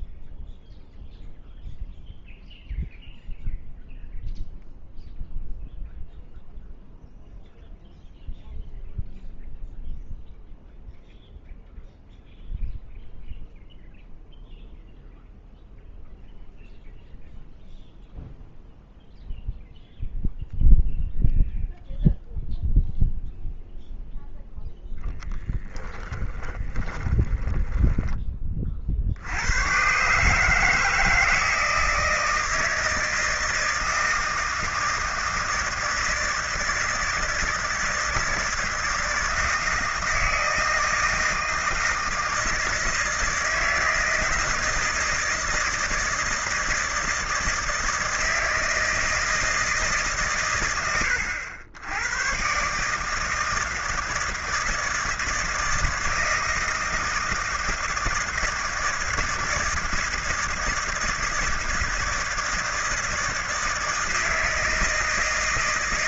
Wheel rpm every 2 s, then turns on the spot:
0, 0, 0, 0, 0, 0, 0, 0, 0, 0, 0, 0, 0, 10, 30, 150, 160, 160, 160, 160, 160, 160, 160, 160, 160, 120, 120, 160, 160, 160, 160, 160, 160.
26-28